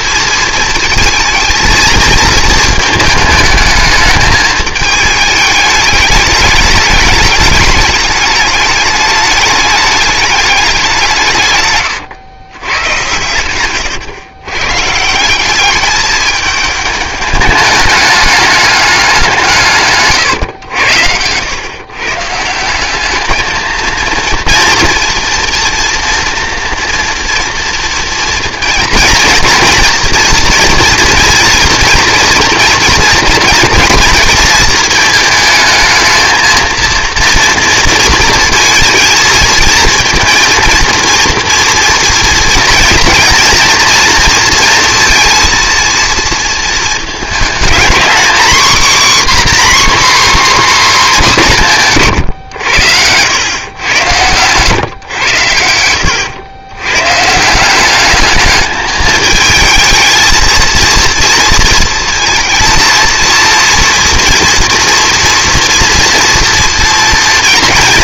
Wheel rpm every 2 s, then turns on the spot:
230, 220, 220, 210, 210, 200, 120, 140, 210, 200, 100, 180, 230, 230, 230, 230, 240, 230, 220, 230, 230, 230, 240, 220, 260, 270, 100, 130, 110, 210, 230, 230, 240, 230.
none